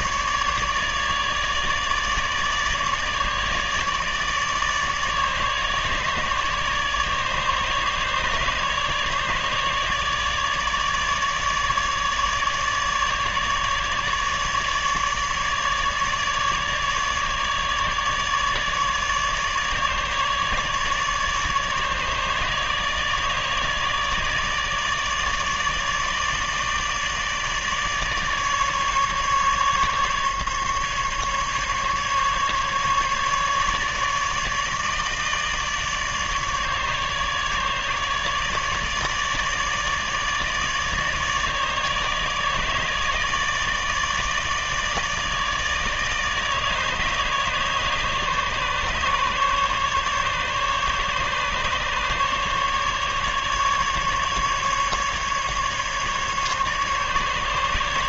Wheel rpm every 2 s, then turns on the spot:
150, 150, 150, 150, 150, 150, 150, 150, 150, 150, 150, 150, 150, 150, 150, 140, 150, 150, 150, 150, 150, 150, 150, 150, 140, 150, 150, 140, 150.
none